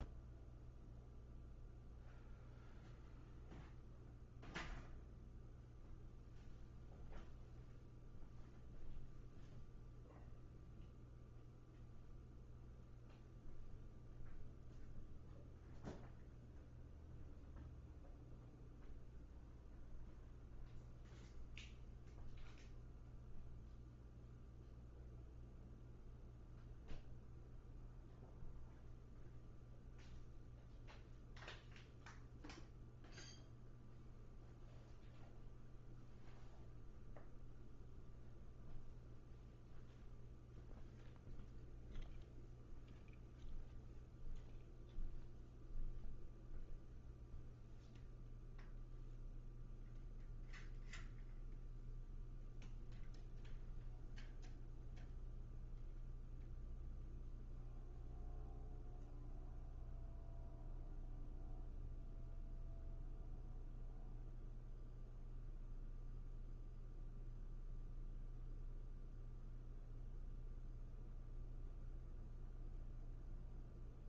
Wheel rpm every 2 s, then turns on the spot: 0, 0, 0, 0, 0, 0, 0, 0, 0, 0, 0, 0, 0, 0, 0, 0, 0, 0, 0, 0, 0, 0, 0, 0, 0, 0, 0, 0, 0, 0, 0, 0, 0, 0, 0, 0, 0.
none